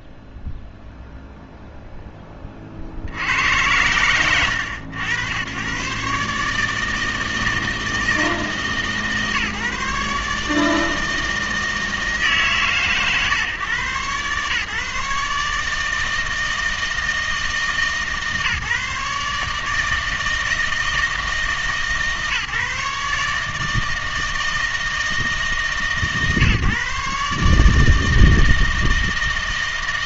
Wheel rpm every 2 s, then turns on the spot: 0, 30, 90, 150, 160, 150, 140, 140, 160, 150, 160, 150, 160, 140, 160.
none